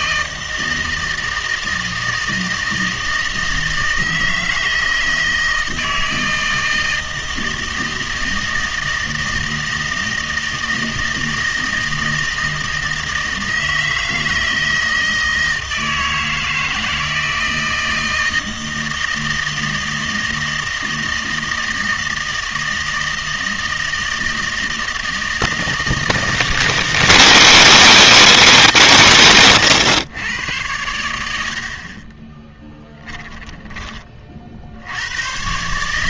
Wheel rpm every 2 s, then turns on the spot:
160, 160, 160, 160, 160, 160, 160, 160, 160, 160, 160, 160, 160, 160, 150, 100, 10, 50.
32-34